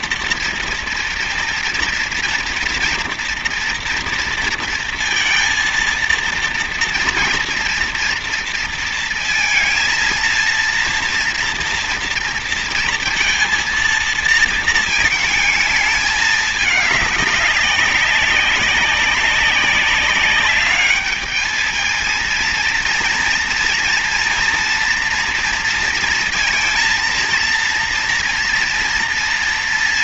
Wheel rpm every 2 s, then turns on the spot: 230, 230, 230, 230, 230, 230, 230, 220, 210, 200, 200, 230, 230, 230, 230.
none